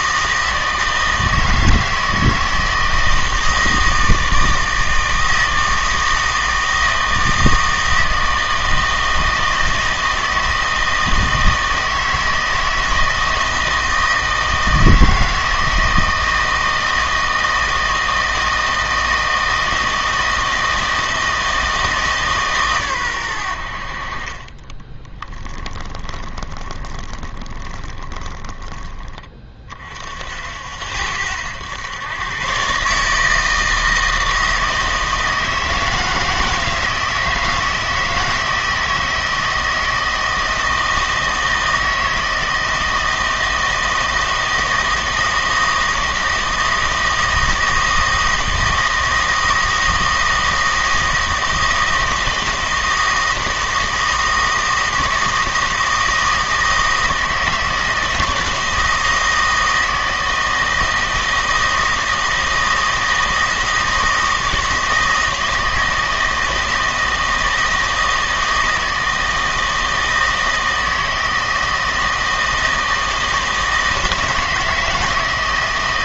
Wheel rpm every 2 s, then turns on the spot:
160, 160, 160, 160, 160, 160, 160, 160, 160, 160, 160, 130, 20, 20, 20, 70, 140, 160, 160, 160, 160, 160, 160, 160, 160, 160, 160, 160, 160, 160, 160, 160, 160, 160, 160, 160, 160, 160.
24-28